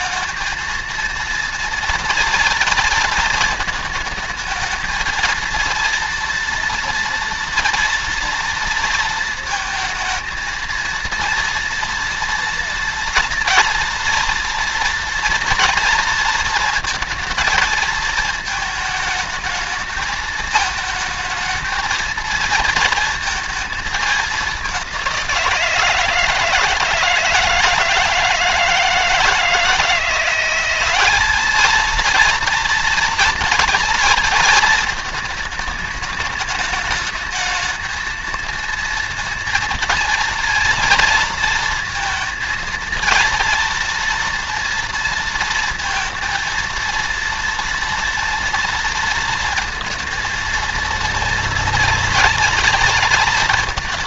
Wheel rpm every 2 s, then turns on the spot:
230, 230, 220, 230, 230, 230, 230, 230, 230, 220, 220, 220, 200, 160, 160, 180, 230, 220, 210, 230, 230, 230, 230, 230, 230, 230, 230.
none